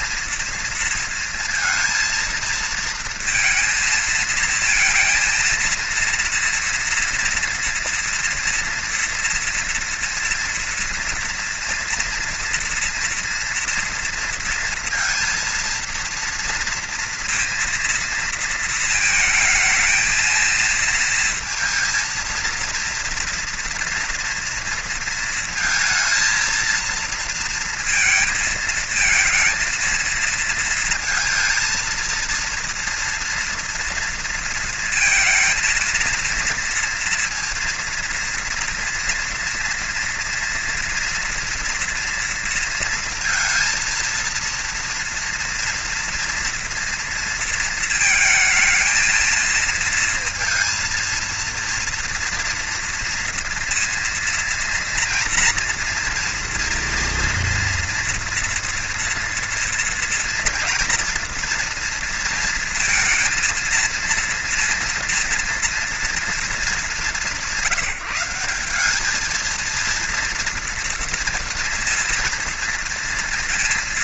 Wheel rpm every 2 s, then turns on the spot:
230, 230, 220, 230, 230, 230, 230, 230, 230, 230, 230, 230, 230, 230, 220, 230, 230, 230, 230, 240, 230, 230, 230, 230, 220, 230, 240, 230, 230, 240, 230, 230, 230, 210, 190, 230, 230.
none